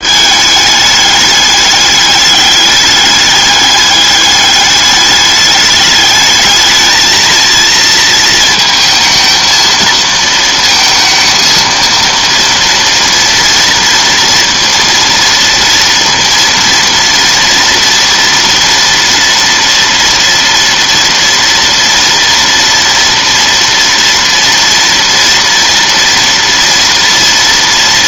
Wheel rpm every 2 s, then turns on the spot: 210, 210, 200, 220, 230, 230, 230, 230, 230, 230, 230, 230, 230, 230.
none